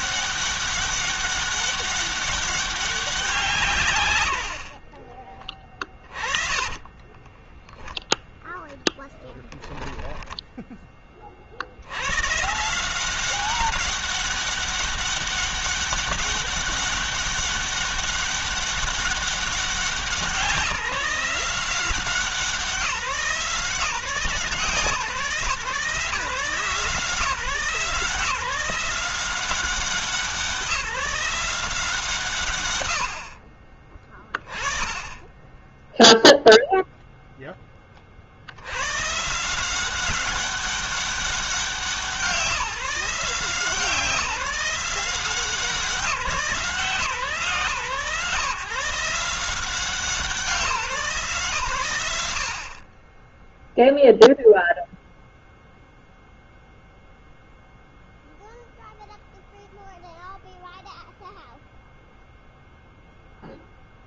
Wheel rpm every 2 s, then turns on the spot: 200, 190, 50, 20, 10, 30, 180, 200, 200, 200, 180, 180, 160, 150, 180, 160, 90, 20, 0, 120, 190, 160, 180, 150, 160, 150, 30, 0, 0, 0, 0, 0.
4-10